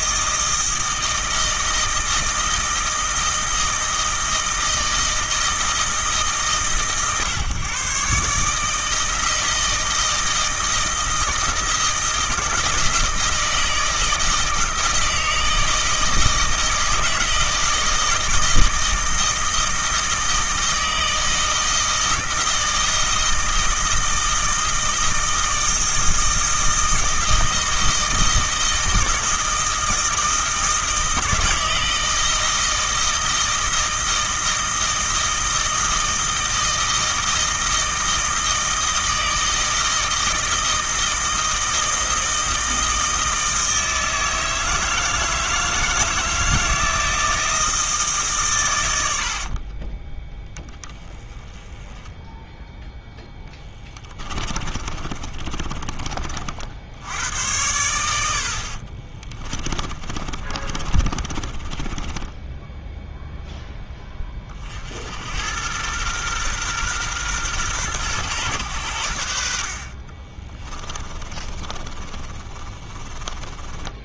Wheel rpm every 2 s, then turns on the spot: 160, 160, 160, 130, 160, 160, 160, 160, 160, 160, 160, 160, 160, 160, 170, 160, 160, 160, 160, 160, 160, 160, 160, 160, 110, 20, 0, 30, 60, 50, 30, 10, 50, 120, 100, 20, 30.
54-56 58-64 70-74